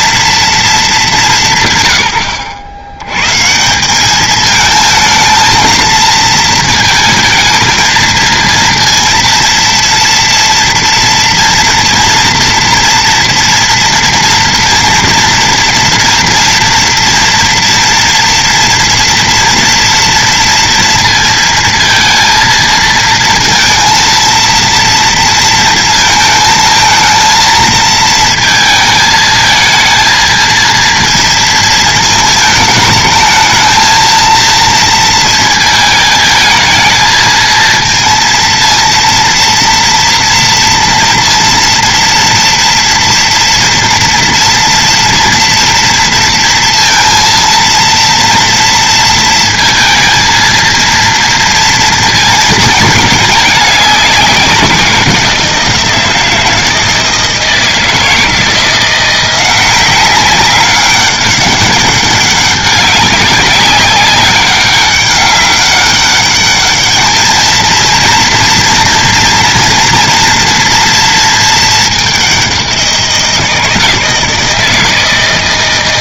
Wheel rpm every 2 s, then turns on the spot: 230, 100, 220, 220, 230, 230, 240, 230, 230, 230, 230, 230, 230, 220, 220, 230, 220, 230, 220, 230, 230, 240, 230, 230, 230, 230, 220, 180, 160, 170, 190, 190, 200, 210, 230, 230, 180, 160.
none